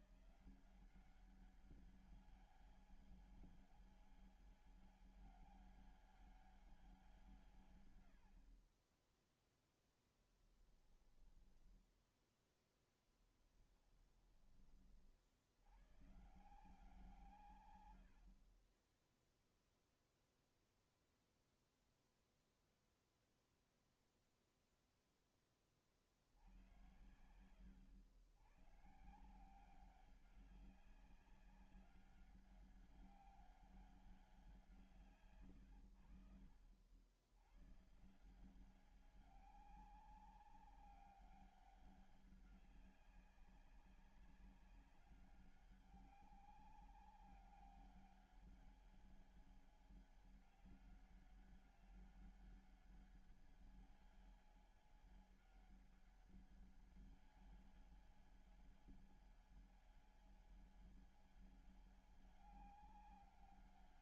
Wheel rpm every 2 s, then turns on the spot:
180, 200, 200, 190, 50, 10, 0, 20, 130, 40, 0, 0, 0, 70, 110, 200, 200, 180, 70, 170, 200, 200, 200, 200, 200, 200, 200, 200, 200, 200, 200, 200.
none